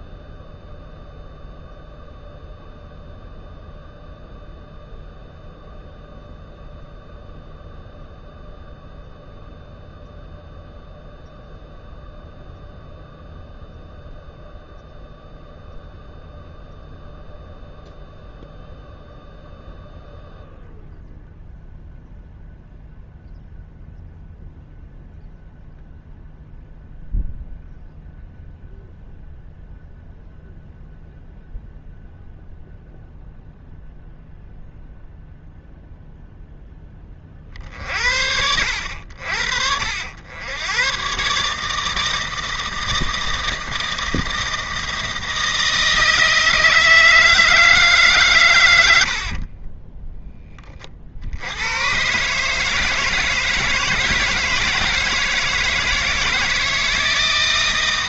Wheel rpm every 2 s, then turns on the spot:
0, 0, 0, 0, 0, 0, 0, 0, 0, 0, 0, 0, 0, 0, 0, 0, 0, 0, 20, 80, 100, 160, 160, 160, 110, 30, 150, 160, 160.
none